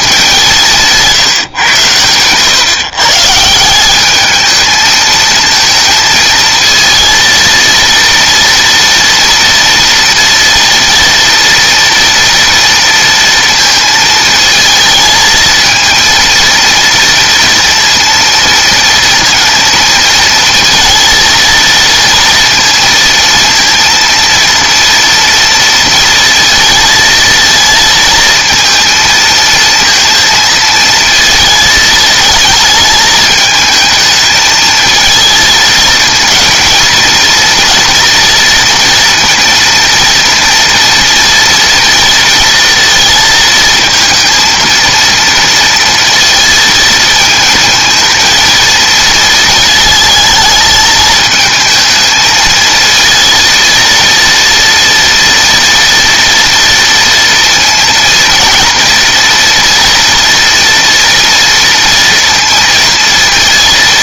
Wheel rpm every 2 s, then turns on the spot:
200, 130, 210, 220, 230, 230, 230, 220, 230, 230, 220, 230, 230, 230, 220, 220, 220, 220, 230, 230, 230, 230, 230, 230, 230, 220, 220, 230, 230, 240, 230, 230.
none